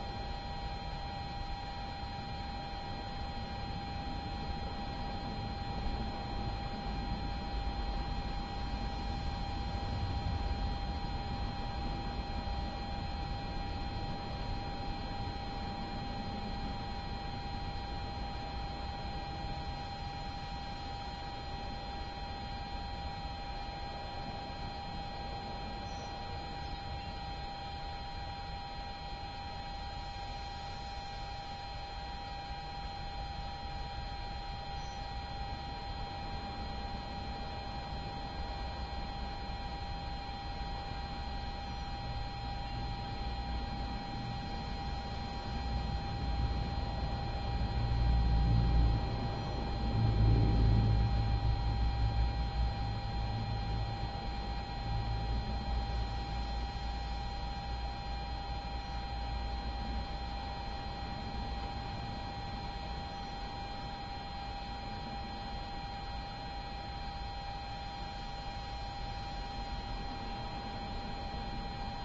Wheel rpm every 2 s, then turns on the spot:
0, 0, 0, 0, 0, 0, 0, 0, 0, 0, 0, 0, 0, 0, 0, 0, 0, 0, 0, 0, 0, 0, 0, 0, 0, 0, 0, 0, 0, 0, 0, 0, 0, 0, 0, 0.
none